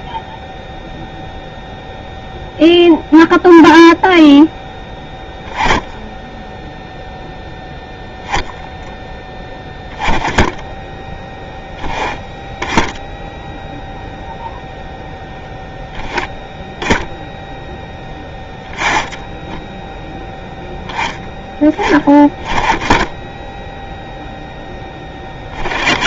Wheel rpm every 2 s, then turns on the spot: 0, 0, 0, 0, 0, 10, 10, 0, 0, 20, 0, 10, 0.
none